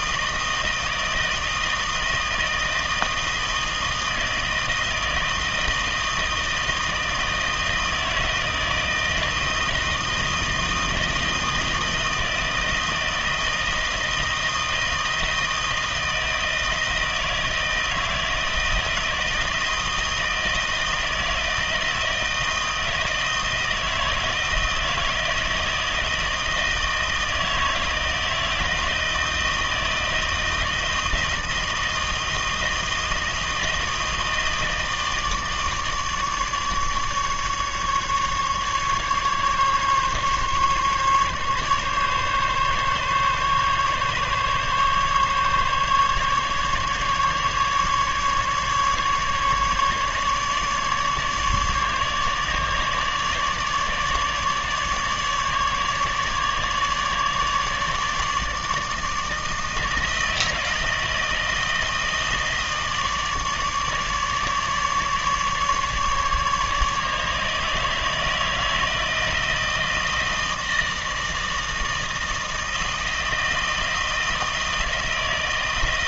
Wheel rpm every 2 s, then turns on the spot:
160, 160, 160, 160, 160, 160, 160, 160, 160, 160, 160, 160, 160, 160, 160, 160, 160, 160, 150, 150, 140, 140, 140, 140, 150, 150, 150, 150, 150, 160, 160, 160, 150, 150, 160, 160, 160, 160.
none